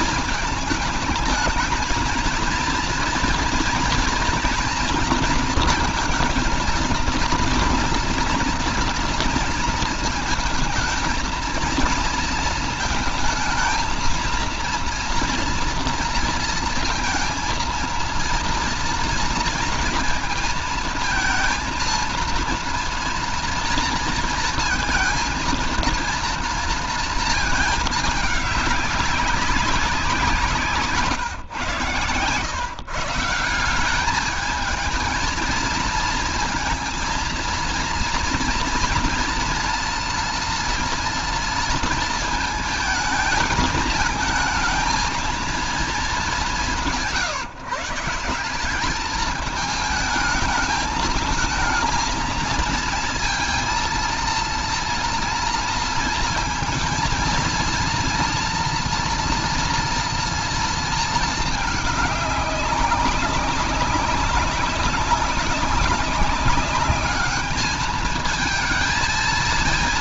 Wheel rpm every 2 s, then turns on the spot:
220, 230, 230, 230, 230, 220, 220, 230, 230, 230, 230, 230, 230, 230, 210, 170, 130, 210, 230, 240, 240, 220, 220, 190, 190, 220, 230, 230, 230, 230, 230, 200, 200, 200, 220.
none